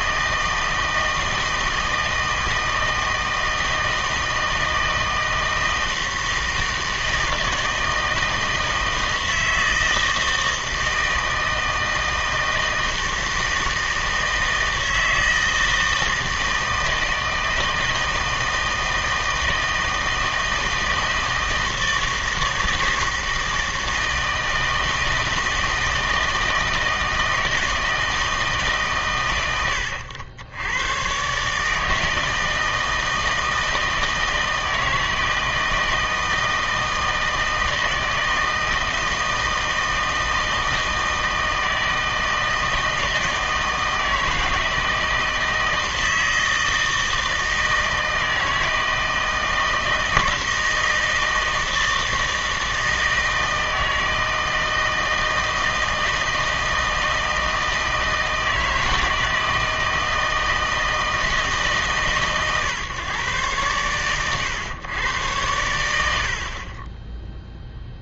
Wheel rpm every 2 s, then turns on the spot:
160, 160, 160, 160, 160, 160, 160, 160, 160, 160, 160, 160, 160, 160, 140, 100, 160, 160, 160, 160, 160, 160, 160, 160, 160, 160, 160, 160, 160, 160, 160, 140, 110, 30.
none